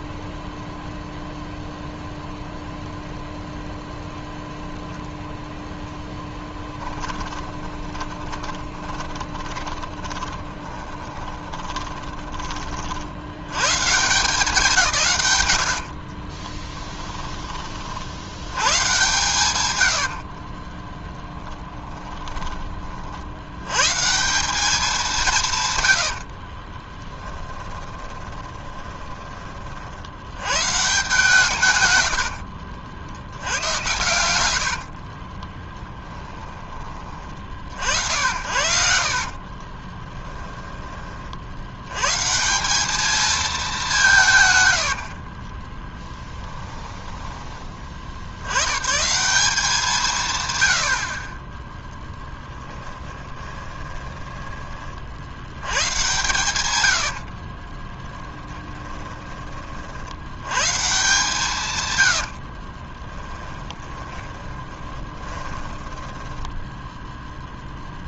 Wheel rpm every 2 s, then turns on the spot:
0, 0, 0, 10, 20, 10, 30, 170, 10, 110, 20, 30, 190, 30, 20, 130, 70, 80, 30, 70, 10, 190, 110, 10, 100, 100, 20, 30, 110, 10, 140, 30, 20, 0.
6-12 16-18 20-22 26-30 34-36 38-40 44-48 52-54 56-60 62-66